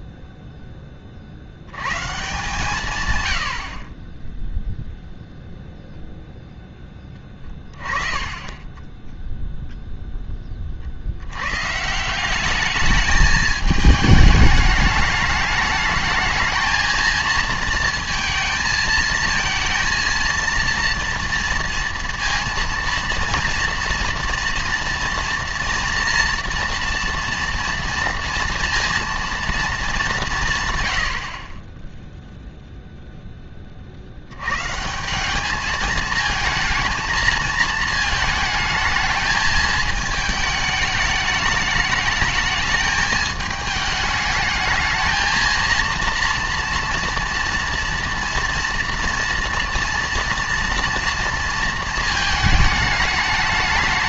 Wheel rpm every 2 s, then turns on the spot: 10, 140, 0, 10, 20, 40, 210, 210, 220, 220, 230, 230, 240, 230, 230, 110, 0, 140, 220, 220, 210, 210, 220, 230, 230, 230, 220.
8-10